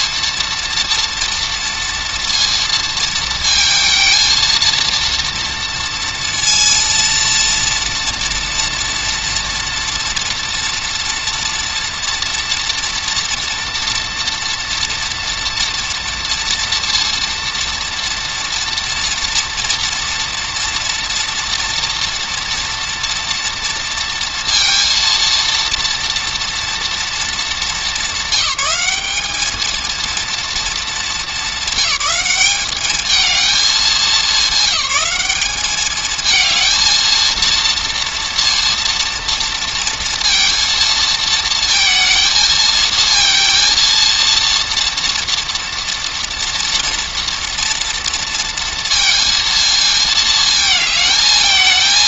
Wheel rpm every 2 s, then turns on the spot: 230, 230, 230, 230, 240, 230, 240, 230, 230, 240, 240, 230, 230, 200, 220, 210, 220, 210, 230, 230, 230, 230, 240, 230, 230, 220.
none